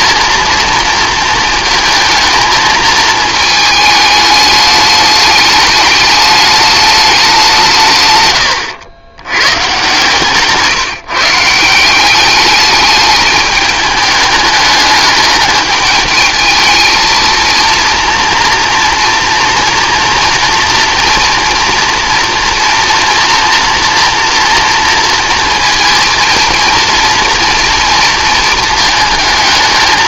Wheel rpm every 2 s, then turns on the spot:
230, 230, 210, 210, 130, 140, 200, 210, 220, 230, 240, 230, 230, 230, 220.
none